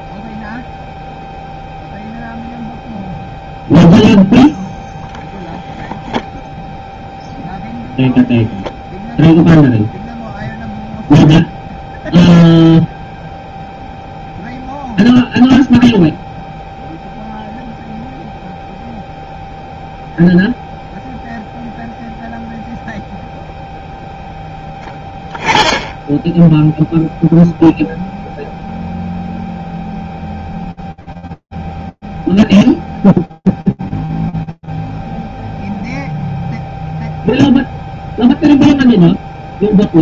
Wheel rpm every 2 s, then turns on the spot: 0, 0, 0, 0, 10, 0, 0, 0, 0, 0, 0, 0, 0, 10, 0, 0, 0, 0, 0, 0.
none